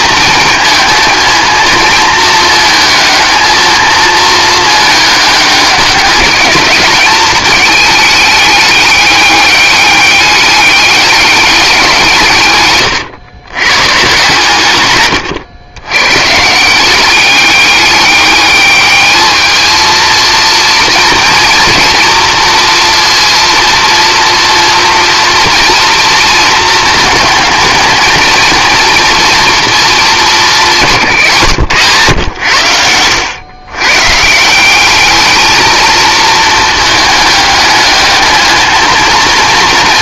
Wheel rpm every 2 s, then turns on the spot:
220, 220, 220, 210, 210, 200, 140, 130, 180, 210, 230, 230, 230, 220, 230, 190, 90, 190, 230, 220.
none